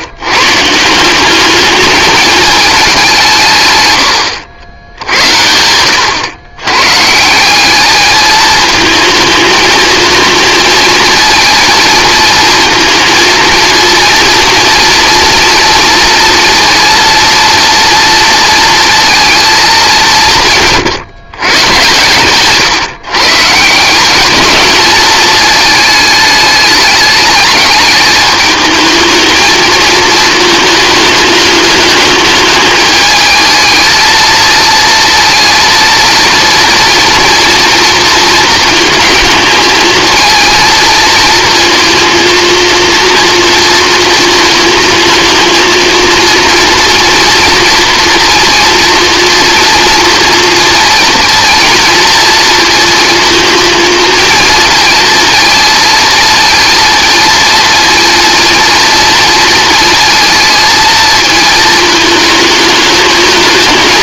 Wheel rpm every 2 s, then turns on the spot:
150, 210, 80, 120, 220, 230, 230, 230, 230, 230, 150, 140, 210, 210, 220, 220, 210, 230, 240, 220, 230, 230, 220, 230, 230, 230, 230, 230, 230, 230, 220, 210.
none